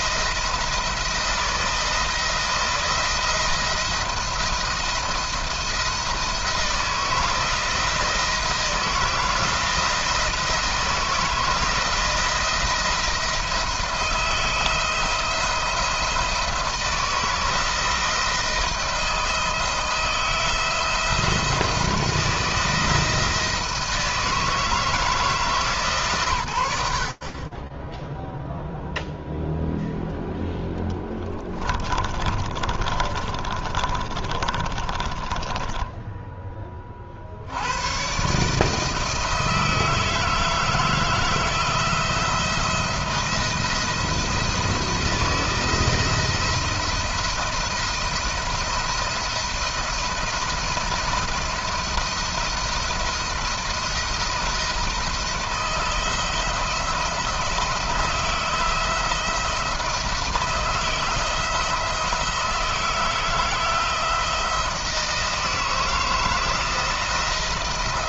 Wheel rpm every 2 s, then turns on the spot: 170, 170, 170, 170, 170, 160, 170, 170, 160, 160, 170, 160, 160, 80, 0, 10, 30, 30, 40, 160, 160, 170, 170, 170, 170, 170, 170, 160, 170, 160, 170, 160, 160, 160.
30-36